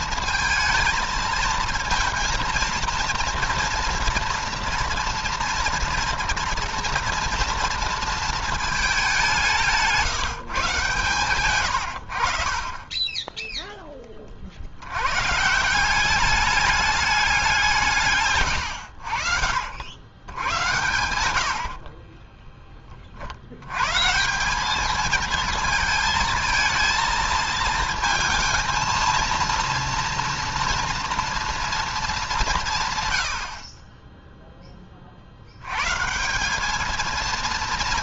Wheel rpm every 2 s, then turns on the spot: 220, 230, 230, 230, 200, 130, 30, 100, 210, 80, 100, 40, 210, 220, 230, 230, 150, 30, 220.
none